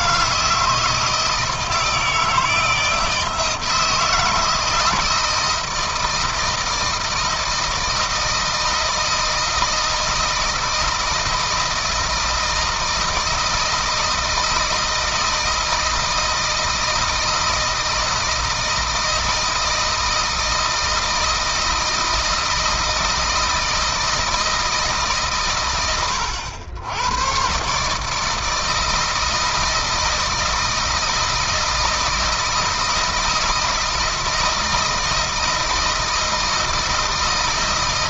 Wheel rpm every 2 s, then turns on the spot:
160, 160, 160, 160, 160, 160, 160, 160, 160, 160, 160, 160, 140, 110, 160, 160, 160, 160, 160.
none